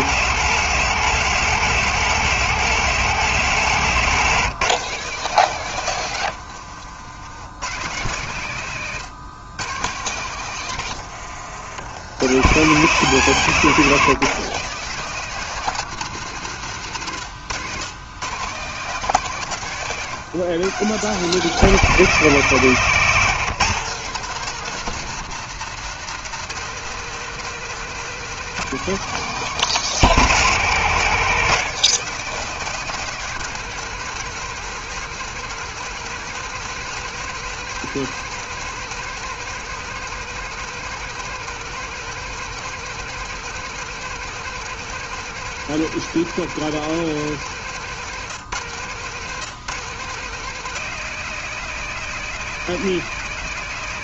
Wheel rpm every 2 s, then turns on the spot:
150, 140, 150, 80, 110, 90, 140, 170, 110, 150, 150, 160, 170, 160, 170, 160, 170, 160, 170, 170, 170, 170, 170, 160, 120, 160, 170.
8-12 18-20